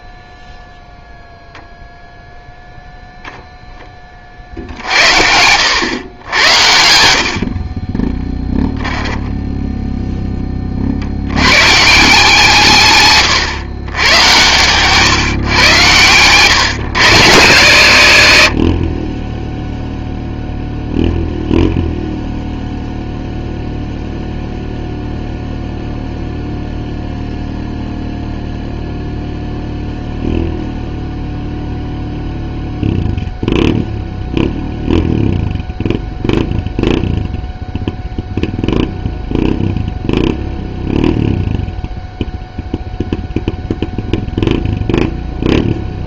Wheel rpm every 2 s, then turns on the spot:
0, 0, 60, 80, 10, 40, 150, 130, 100, 20, 0, 0, 0, 0, 0, 0, 0, 0, 0, 0, 0, 0, 0.
8-10